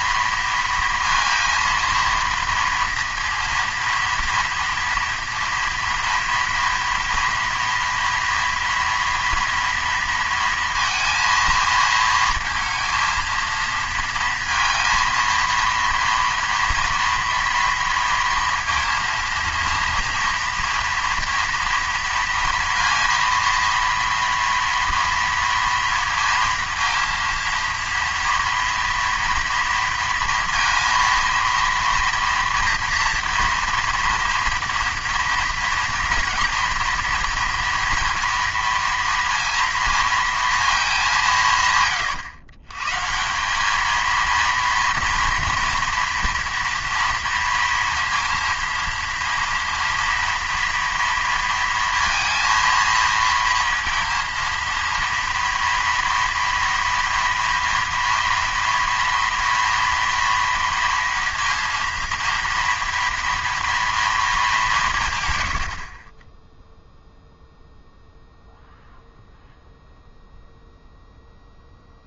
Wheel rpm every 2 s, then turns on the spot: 230, 230, 230, 230, 230, 230, 230, 230, 230, 230, 230, 230, 230, 230, 230, 230, 230, 230, 230, 230, 210, 130, 230, 230, 230, 230, 230, 230, 230, 230, 230, 230, 190, 0, 0, 0.
none